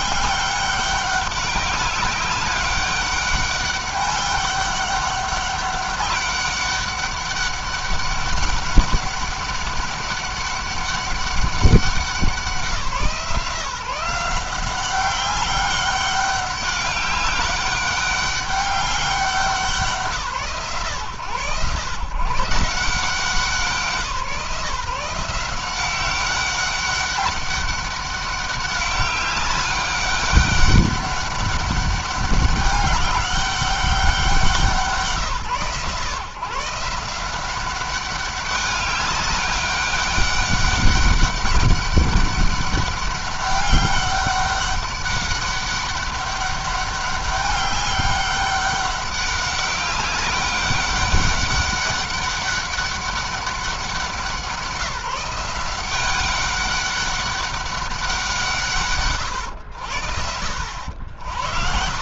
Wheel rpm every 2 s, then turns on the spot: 200, 200, 200, 200, 200, 200, 170, 190, 200, 200, 130, 150, 160, 200, 200, 200, 200, 160, 150, 190, 200, 200, 200, 200, 200, 200, 200, 170, 200, 160, 80.
none